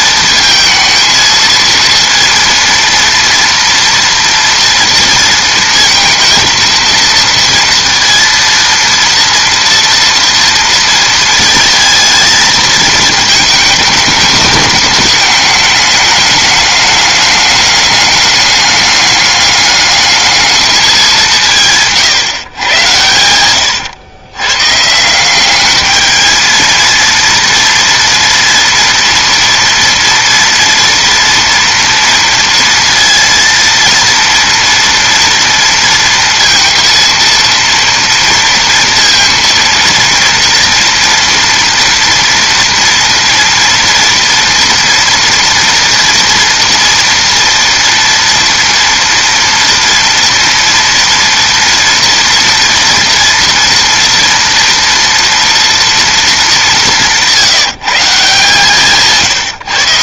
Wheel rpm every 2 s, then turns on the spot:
220, 230, 230, 230, 230, 230, 220, 210, 210, 210, 210, 110, 140, 220, 230, 230, 230, 230, 230, 230, 230, 240, 230, 230, 230, 230, 230, 230, 180, 150.
none